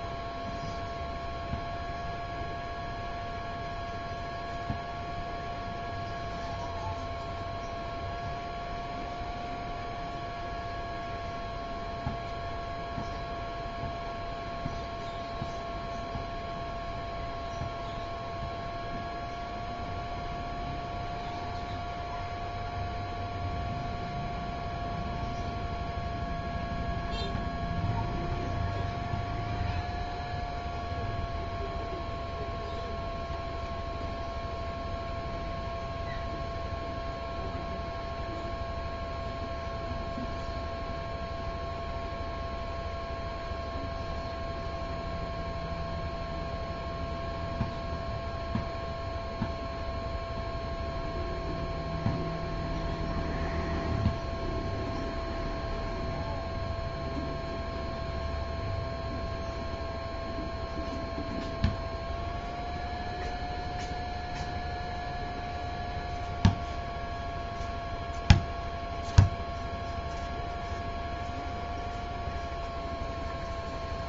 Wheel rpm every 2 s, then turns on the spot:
0, 0, 0, 0, 0, 0, 0, 0, 0, 0, 0, 0, 0, 0, 0, 0, 0, 0, 0, 0, 0, 0, 0, 0, 0, 0, 0, 0, 0, 0, 0, 0, 0, 0, 0, 0, 0.
none